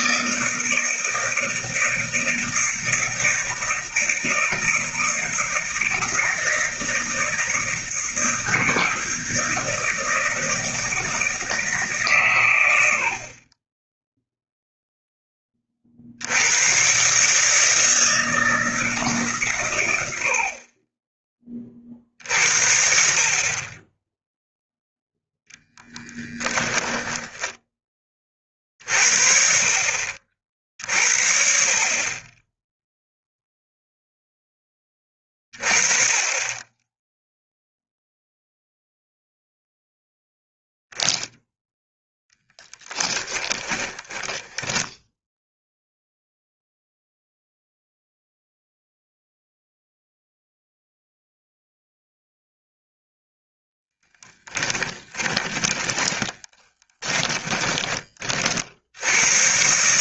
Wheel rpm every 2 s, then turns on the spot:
160, 160, 160, 160, 160, 160, 100, 0, 130, 150, 30, 50, 0, 10, 40, 40, 0, 20, 10, 0, 0, 10, 0, 0, 0, 0, 0, 20, 10, 80.
26-28 42-44 54-58